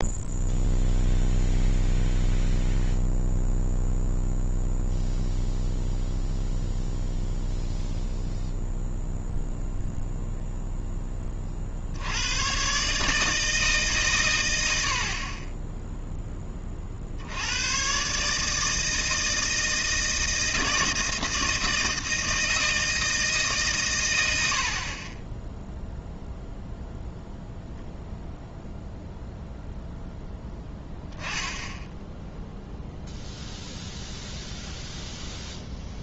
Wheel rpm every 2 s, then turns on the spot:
0, 0, 0, 0, 0, 0, 120, 100, 30, 160, 160, 160, 80, 0, 0, 10, 0, 0.
none